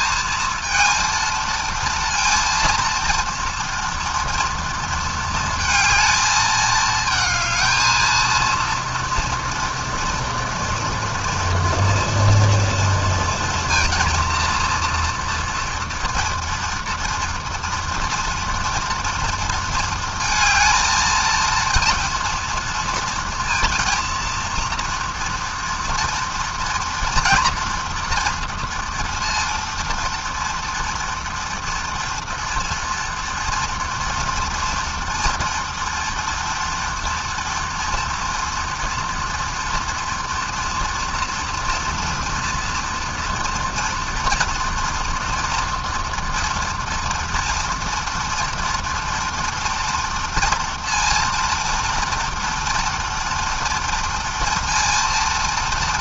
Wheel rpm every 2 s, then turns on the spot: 230, 230, 230, 220, 230, 230, 230, 230, 230, 230, 220, 230, 230, 240, 230, 240, 230, 240, 230, 230, 240, 230, 230, 230, 230, 230, 230, 230.
none